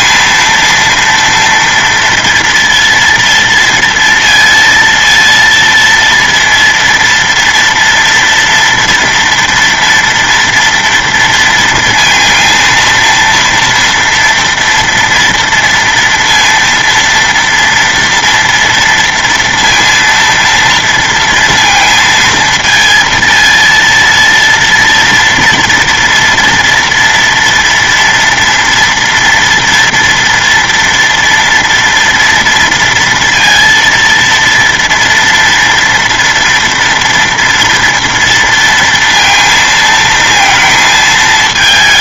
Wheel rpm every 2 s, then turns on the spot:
230, 230, 230, 230, 240, 230, 230, 230, 240, 230, 230, 230, 230, 230, 230, 230, 230, 230, 230, 230, 220.
none